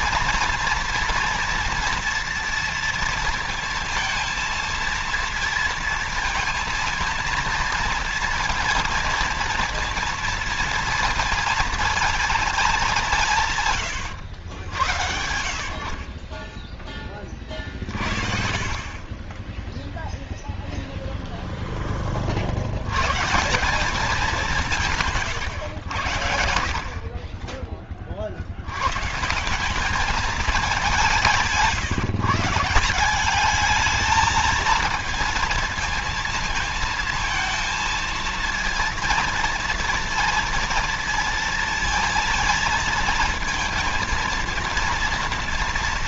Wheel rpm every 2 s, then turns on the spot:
240, 230, 230, 230, 230, 230, 180, 90, 20, 30, 0, 110, 160, 40, 120, 190, 180, 220, 220, 230, 230, 230, 230.
none